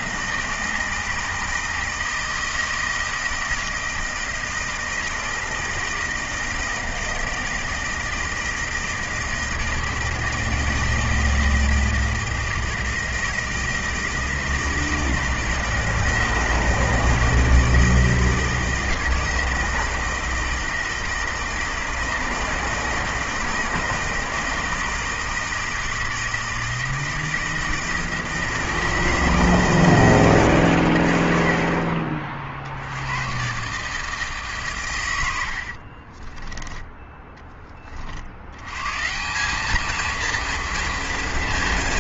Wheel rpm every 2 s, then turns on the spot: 160, 160, 160, 160, 160, 160, 160, 160, 160, 160, 160, 160, 160, 160, 160, 140, 60, 140, 10, 110, 230.
none